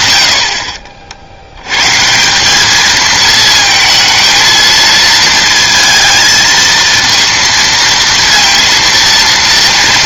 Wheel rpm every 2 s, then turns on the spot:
60, 200, 230, 220, 230.
none